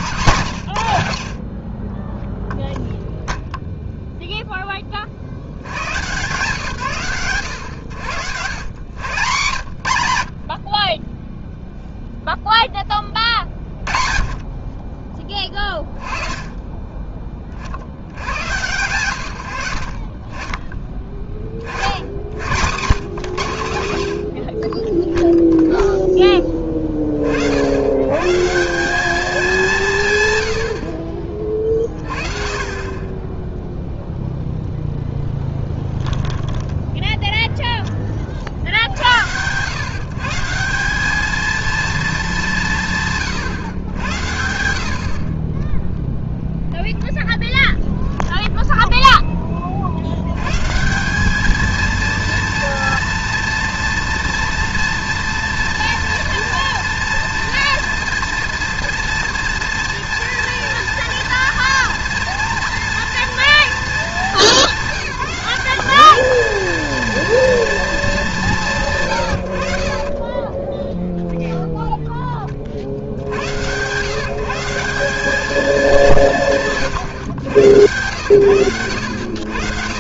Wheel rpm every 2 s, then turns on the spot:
130, 0, 10, 130, 110, 40, 10, 30, 30, 100, 20, 100, 30, 20, 180, 70, 30, 0, 10, 60, 170, 180, 80, 0, 0, 140, 230, 230, 230, 230, 230, 230, 210, 230, 190, 20, 50, 170, 140, 110.
36-38 70-72